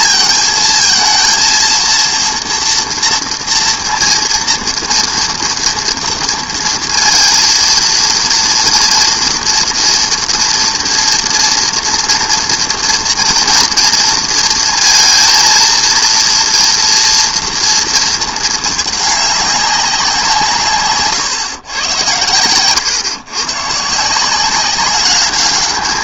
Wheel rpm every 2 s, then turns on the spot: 230, 230, 230, 230, 230, 230, 230, 230, 230, 220, 150, 110, 180.
none